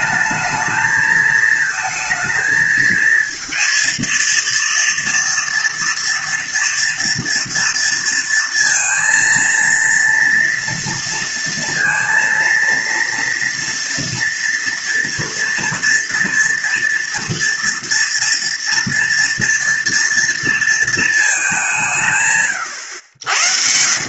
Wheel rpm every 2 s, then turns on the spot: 220, 220, 230, 240, 230, 230, 230, 230, 230, 240, 230, 110.
none